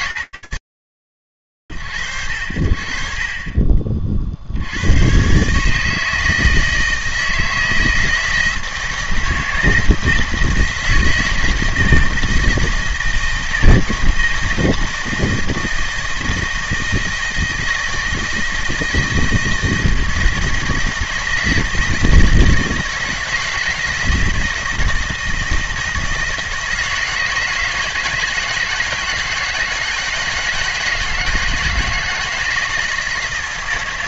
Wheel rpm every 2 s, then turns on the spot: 100, 50, 120, 160, 160, 160, 160, 160, 160, 160, 160, 160, 160, 160, 160, 160, 160.
none